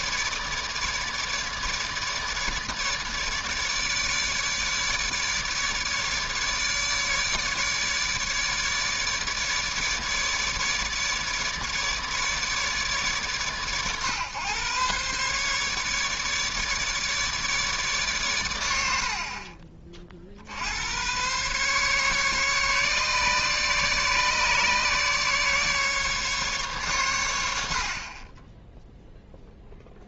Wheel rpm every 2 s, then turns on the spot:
150, 150, 150, 150, 150, 150, 140, 130, 150, 90, 80, 140, 140, 130, 0.
none